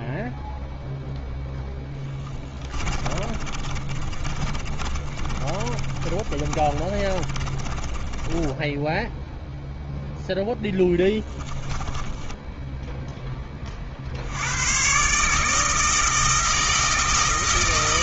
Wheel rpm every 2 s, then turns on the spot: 0, 20, 30, 30, 10, 20, 30, 160, 160.
2-12